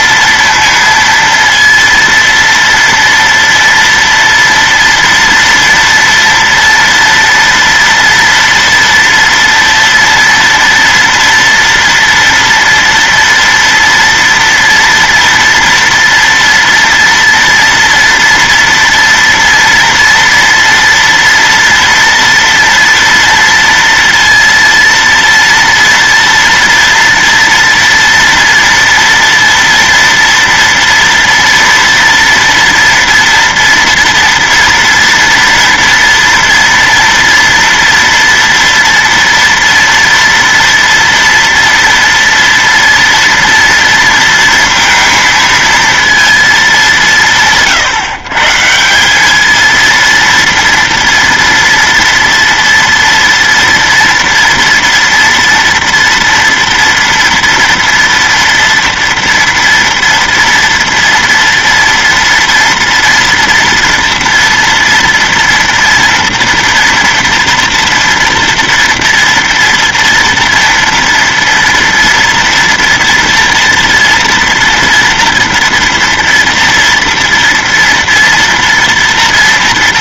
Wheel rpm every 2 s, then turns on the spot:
230, 230, 230, 240, 230, 240, 230, 230, 230, 230, 230, 230, 230, 230, 240, 230, 230, 230, 230, 240, 230, 230, 230, 220, 140, 230, 230, 230, 230, 230, 230, 230, 230, 230, 230, 230, 230, 230, 230, 230.
none